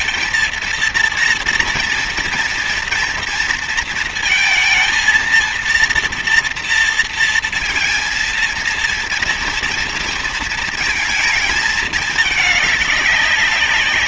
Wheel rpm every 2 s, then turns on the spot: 230, 230, 230, 230, 230, 230, 210.
none